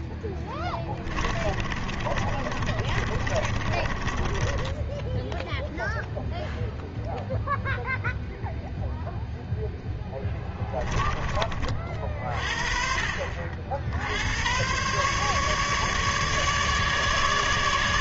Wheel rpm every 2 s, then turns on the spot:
10, 30, 10, 0, 0, 20, 40, 110, 150.
0-6 10-12